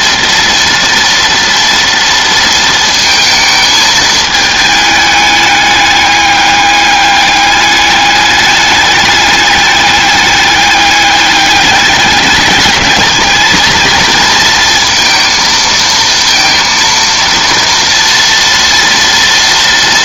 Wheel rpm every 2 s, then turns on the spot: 230, 220, 210, 200, 210, 200, 220, 230, 230, 230.
none